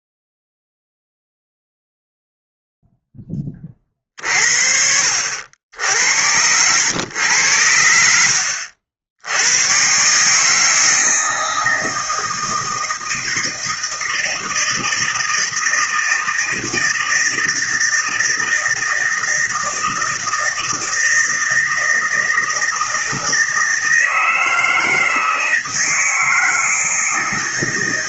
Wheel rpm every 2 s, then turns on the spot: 0, 0, 40, 80, 70, 140, 160, 160, 160, 160, 160, 160, 160, 160.
none